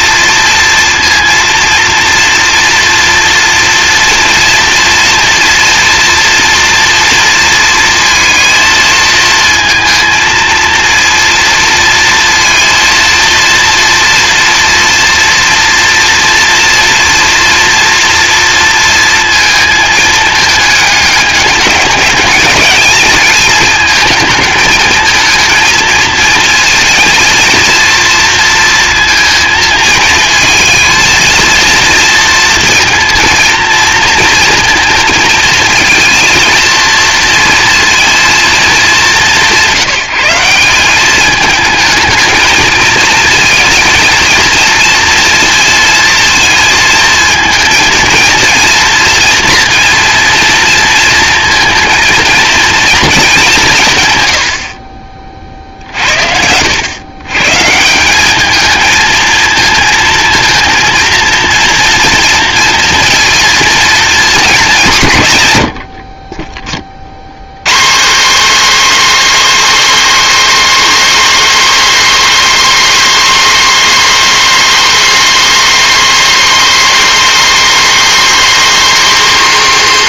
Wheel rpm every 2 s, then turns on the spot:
230, 230, 230, 230, 230, 230, 230, 230, 230, 230, 210, 220, 220, 220, 230, 220, 230, 230, 230, 220, 180, 220, 230, 230, 230, 230, 230, 80, 90, 210, 220, 230, 200, 30, 260, 280, 280, 280, 280, 280.
none